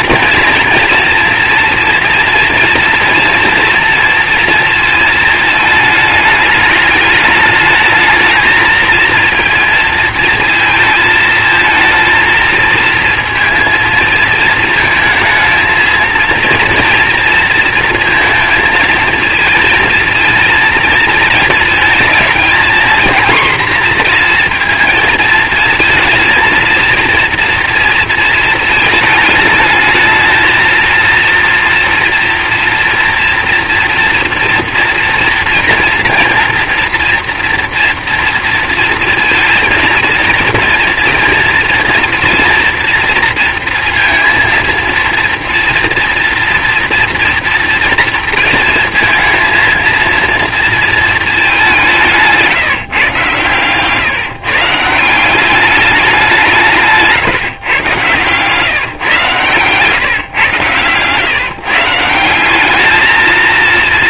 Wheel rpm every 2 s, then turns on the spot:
240, 230, 220, 210, 230, 220, 230, 230, 230, 230, 230, 240, 220, 230, 220, 230, 230, 240, 230, 230, 230, 230, 230, 240, 230, 220, 120, 180, 150, 130, 130, 220.
none